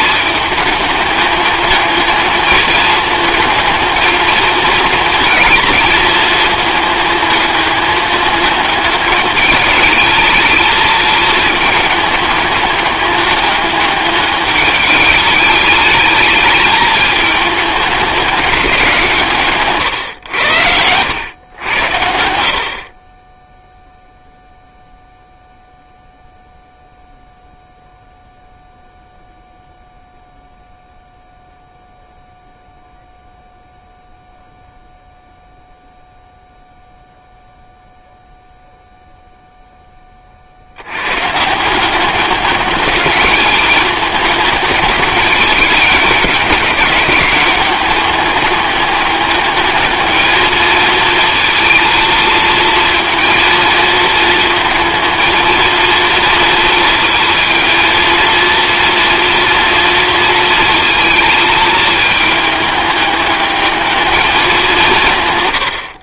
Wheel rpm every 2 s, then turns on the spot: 210, 220, 220, 210, 210, 220, 210, 210, 220, 180, 100, 40, 0, 0, 0, 0, 0, 0, 0, 0, 80, 200, 210, 200, 210, 220, 230, 230, 230, 230, 230, 210, 180.
none